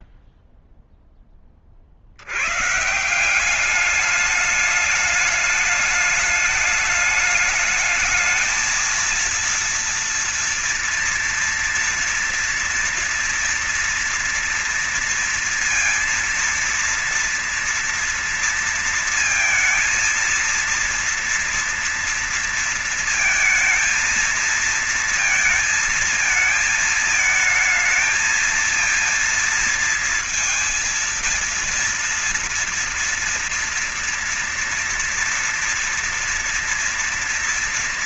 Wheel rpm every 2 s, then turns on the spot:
0, 110, 210, 210, 220, 230, 230, 230, 230, 230, 230, 230, 230, 220, 230, 230, 230, 230, 230.
none